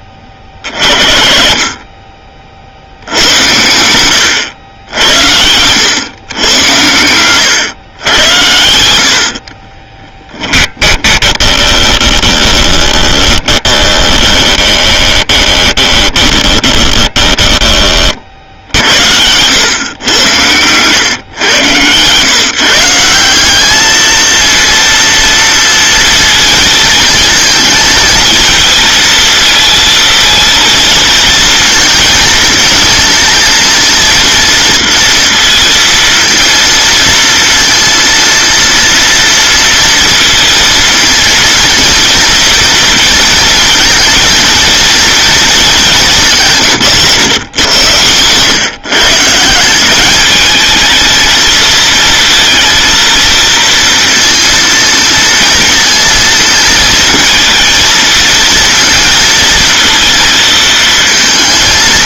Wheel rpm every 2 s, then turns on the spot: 40, 60, 80, 100, 90, 20, 20, 20, 30, 70, 120, 160, 230, 220, 220, 230, 230, 230, 230, 230, 230, 230, 230, 150, 140, 220, 230, 230, 230, 230, 220.
10-18